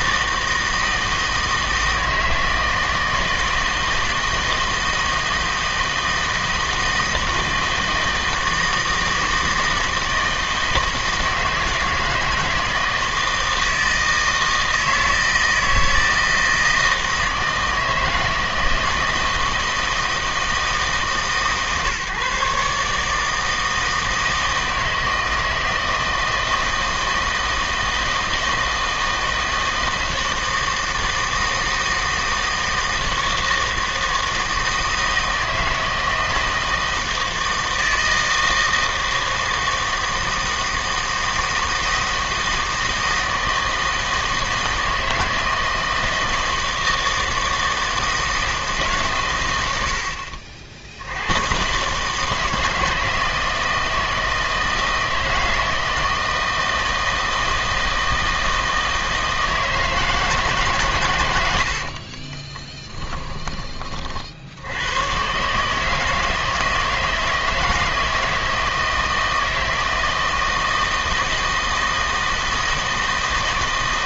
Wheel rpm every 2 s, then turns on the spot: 160, 160, 160, 160, 160, 160, 160, 160, 160, 160, 150, 140, 160, 160, 160, 160, 160, 160, 160, 160, 160, 160, 160, 160, 150, 60, 160, 160, 160, 160, 140, 10, 70, 160, 160, 160, 160.
62-64